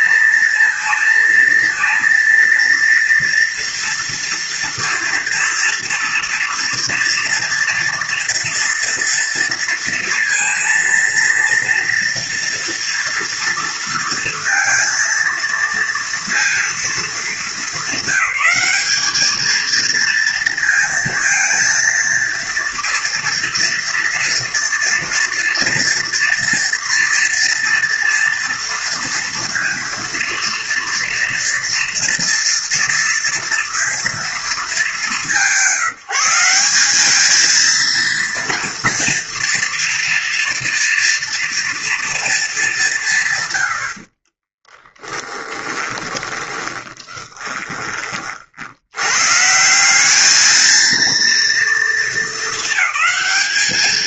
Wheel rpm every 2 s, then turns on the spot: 230, 230, 230, 230, 230, 230, 230, 230, 230, 200, 230, 230, 230, 230, 230, 230, 230, 210, 200, 230, 230, 190, 20, 20, 90, 230, 210.
44-48